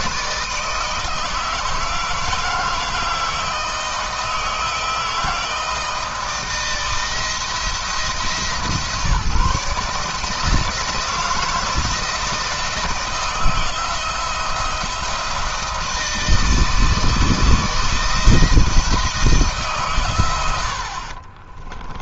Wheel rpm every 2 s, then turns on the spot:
160, 160, 160, 160, 140, 160, 160, 170, 160, 160, 50.
20-22